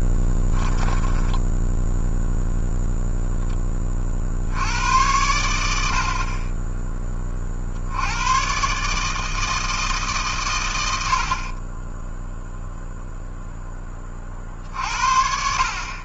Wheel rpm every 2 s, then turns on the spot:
10, 0, 60, 30, 120, 130, 0, 50.
0-2